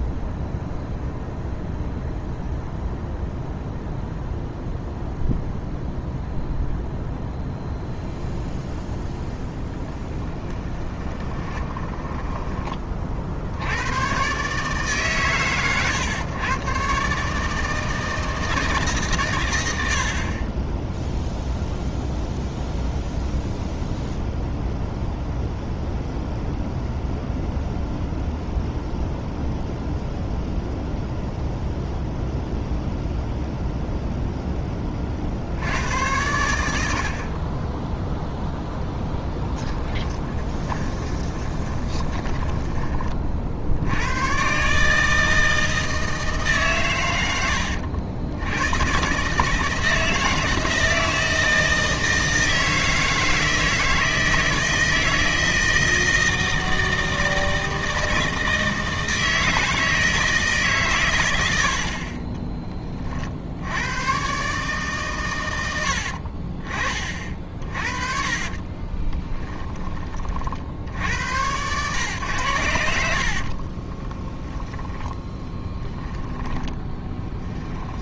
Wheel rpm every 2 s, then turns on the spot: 0, 0, 0, 0, 0, 10, 20, 140, 130, 150, 20, 0, 0, 0, 0, 0, 0, 10, 80, 0, 20, 20, 140, 130, 110, 160, 160, 160, 160, 160, 140, 20, 130, 40, 30, 70, 90, 10, 30.
10-12 40-42 68-70 74-78